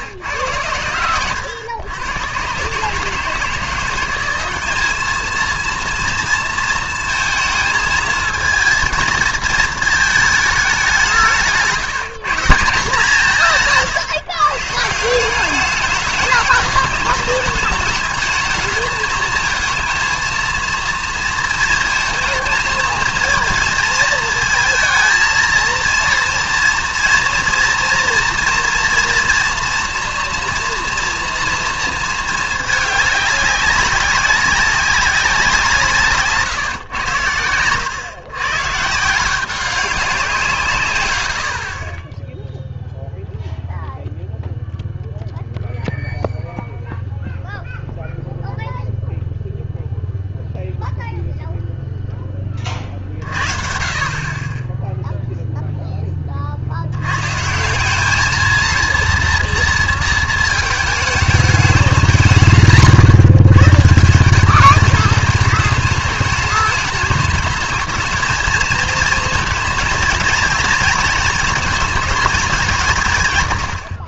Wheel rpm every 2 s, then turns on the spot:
90, 130, 200, 230, 220, 200, 170, 150, 210, 220, 230, 220, 220, 230, 230, 230, 210, 200, 130, 140, 150, 0, 0, 0, 0, 0, 30, 20, 50, 230, 220, 130, 210, 210, 220, 230, 200.
none